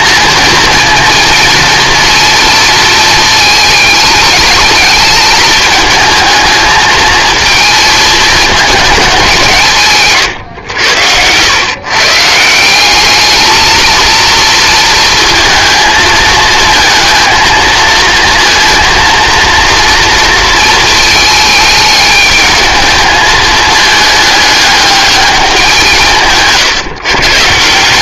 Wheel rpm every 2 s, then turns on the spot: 230, 230, 210, 220, 220, 120, 170, 230, 220, 230, 230, 210, 210, 150.
none